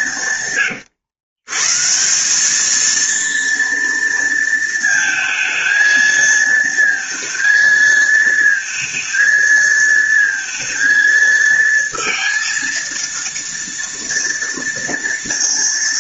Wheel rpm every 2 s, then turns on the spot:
120, 220, 230, 230, 230, 230, 230, 230.
none